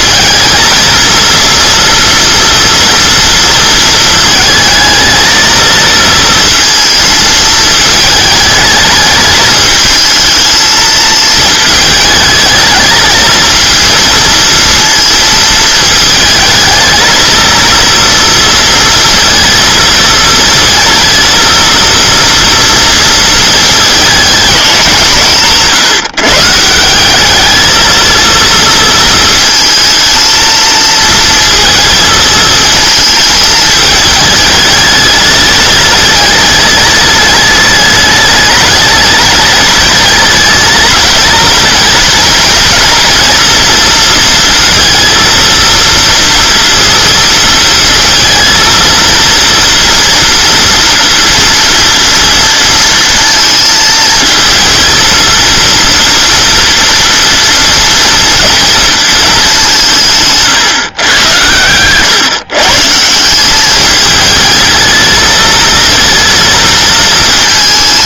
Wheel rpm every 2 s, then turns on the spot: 230, 240, 220, 230, 220, 220, 220, 230, 220, 230, 230, 230, 200, 170, 230, 230, 220, 210, 210, 210, 210, 230, 230, 230, 230, 240, 230, 230, 230, 230, 140, 140, 220, 220.
none